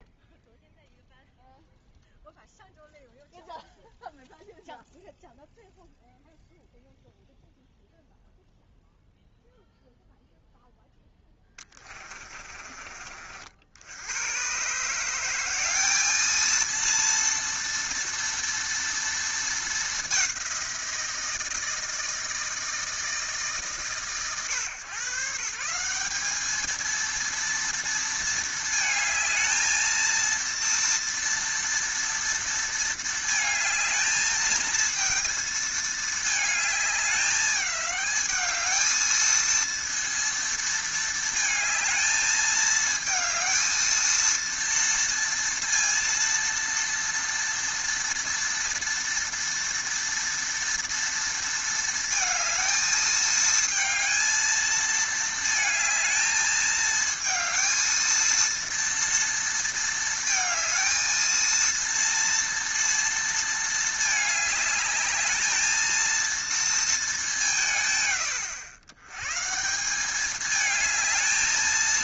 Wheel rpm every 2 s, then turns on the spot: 0, 0, 0, 0, 0, 0, 40, 140, 230, 230, 170, 160, 120, 220, 220, 230, 230, 220, 210, 220, 230, 220, 230, 230, 230, 230, 220, 220, 220, 230, 230, 230, 210, 230, 110, 220.
none